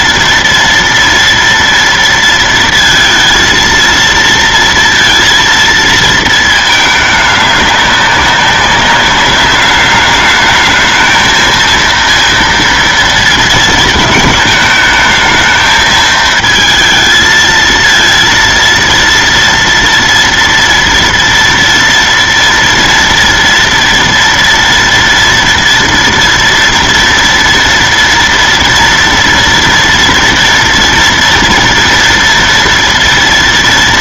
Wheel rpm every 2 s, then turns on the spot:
230, 230, 230, 220, 200, 210, 230, 220, 220, 230, 230, 230, 230, 230, 240, 230, 230.
none